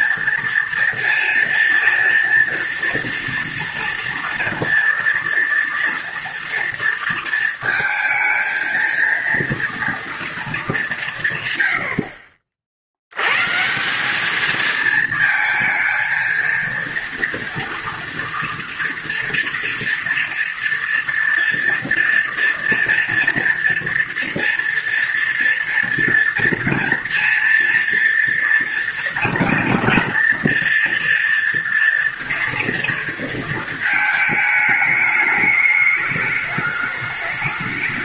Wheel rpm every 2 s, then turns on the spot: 240, 230, 240, 230, 230, 210, 50, 220, 230, 230, 240, 230, 230, 230, 230, 230, 230, 220, 210.
none